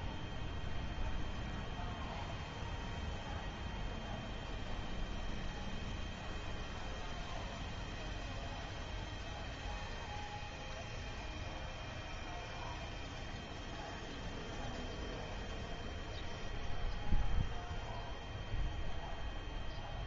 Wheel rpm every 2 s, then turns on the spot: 0, 0, 0, 0, 0, 0, 0, 0, 0, 0.
none